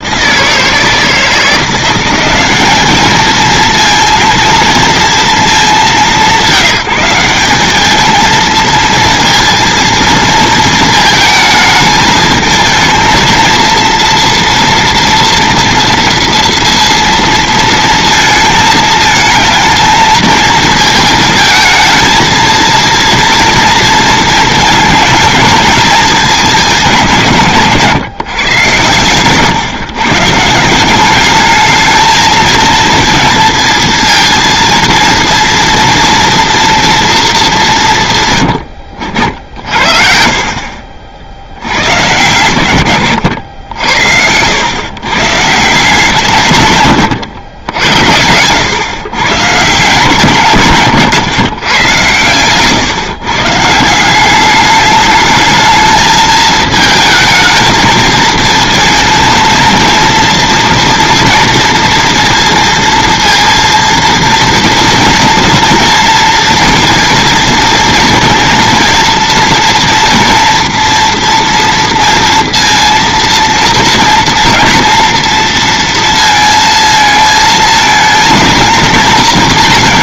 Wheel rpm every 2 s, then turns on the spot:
160, 200, 230, 180, 220, 220, 220, 240, 230, 220, 220, 230, 220, 190, 130, 160, 220, 230, 230, 110, 50, 130, 90, 150, 100, 140, 120, 200, 220, 220, 230, 230, 230, 230, 230, 230, 230, 230, 230, 230.
none